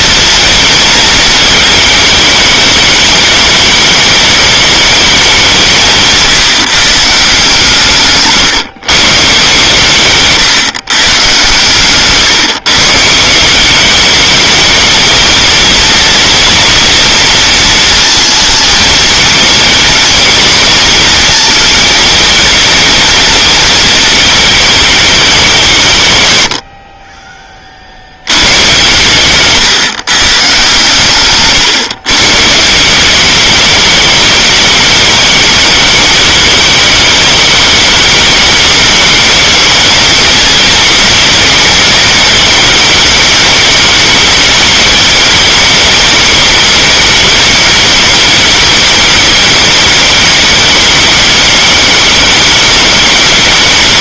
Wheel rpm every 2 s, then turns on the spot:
220, 210, 210, 150, 150, 150, 140, 210, 230, 230, 230, 220, 220, 100, 110, 140, 150, 210, 220, 210, 220, 210, 210, 210, 210, 210, 210.
none